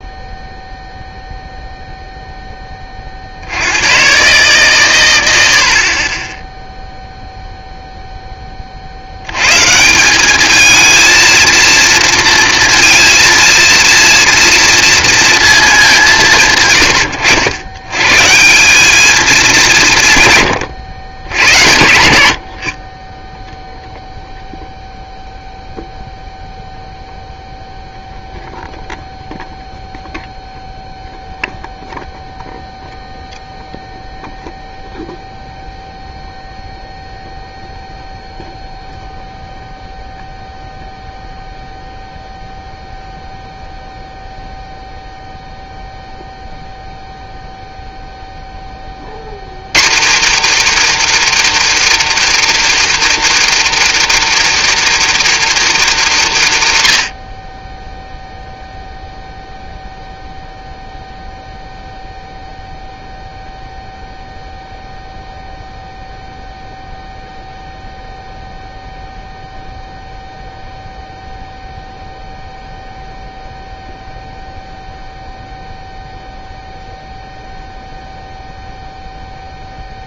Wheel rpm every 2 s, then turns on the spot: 0, 20, 140, 10, 30, 220, 230, 230, 130, 190, 120, 60, 0, 0, 0, 0, 0, 0, 0, 0, 0, 0, 0, 0, 20, 290, 320, 320, 180, 0, 0, 0, 0, 0, 0, 0, 0, 0, 0, 0.
none